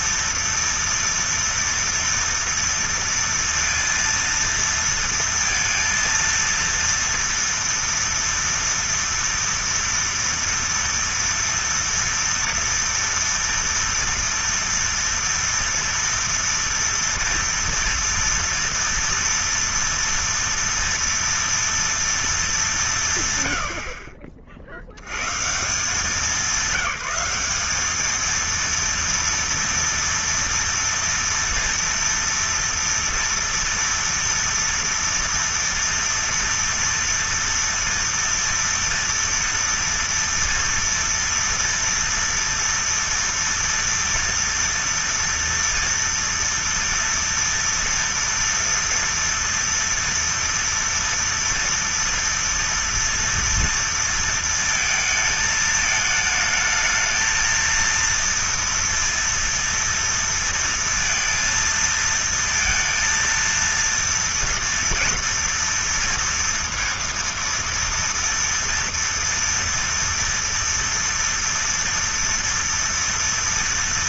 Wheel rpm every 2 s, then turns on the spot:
230, 230, 230, 230, 230, 230, 230, 240, 230, 230, 230, 190, 50, 210, 230, 230, 230, 230, 230, 230, 230, 230, 240, 230, 230, 230, 230, 220, 220, 230, 230, 230, 230, 230, 230, 240, 240.
none